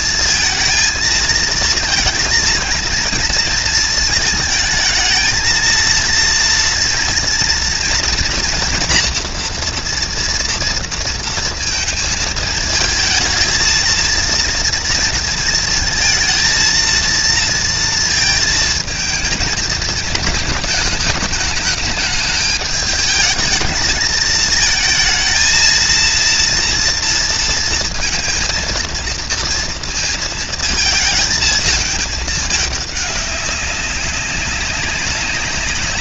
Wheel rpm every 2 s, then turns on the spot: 220, 230, 220, 230, 240, 230, 220, 230, 230, 220, 220, 220, 230, 230, 230, 220, 200, 190.
none